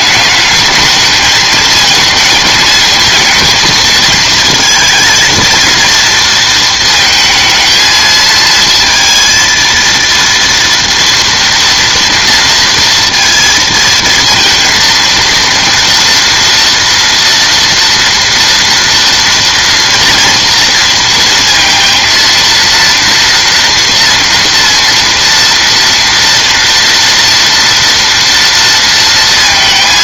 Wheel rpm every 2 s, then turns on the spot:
210, 220, 230, 230, 230, 230, 230, 230, 230, 230, 230, 230, 230, 230, 230.
none